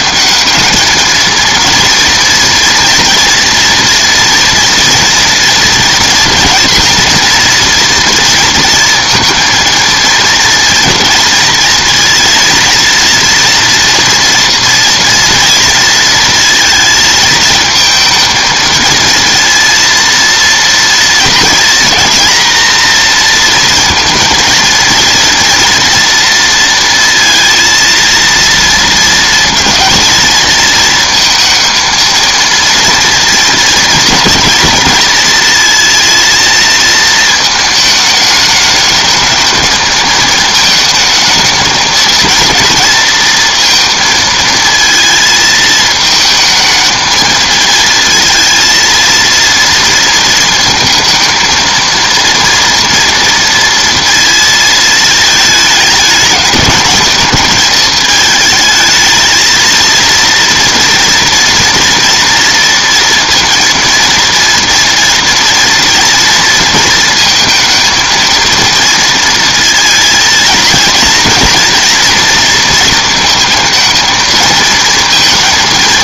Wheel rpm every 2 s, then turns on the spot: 210, 230, 240, 230, 230, 230, 230, 230, 230, 220, 230, 230, 230, 230, 230, 220, 230, 220, 230, 210, 220, 220, 230, 220, 230, 230, 230, 230, 210, 220, 230, 230, 230, 230, 230, 230, 230, 230.
none